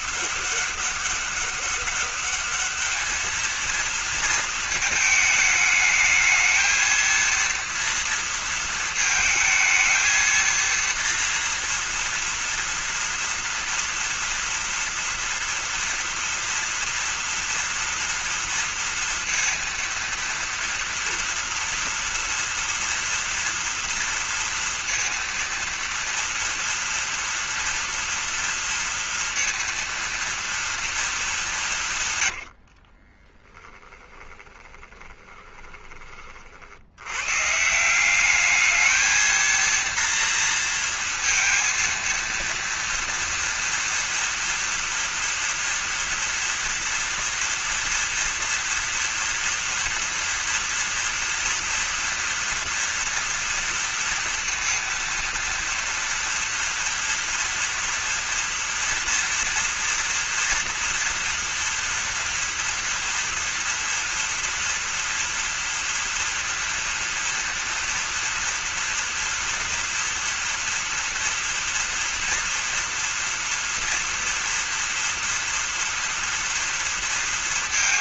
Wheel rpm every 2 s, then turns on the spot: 200, 210, 220, 220, 230, 230, 230, 230, 230, 230, 240, 230, 230, 230, 230, 230, 60, 20, 70, 210, 230, 230, 230, 230, 230, 230, 230, 230, 230, 240, 240, 230, 230, 230, 240, 230, 230, 230, 230.
32-36